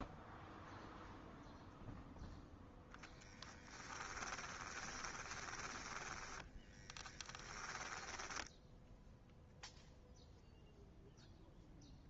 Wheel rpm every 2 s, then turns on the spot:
0, 0, 20, 20, 10, 0.
4-10